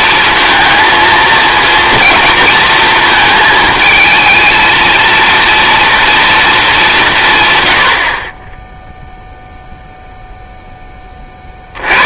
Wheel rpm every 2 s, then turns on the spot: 220, 230, 220, 200, 10, 10.
none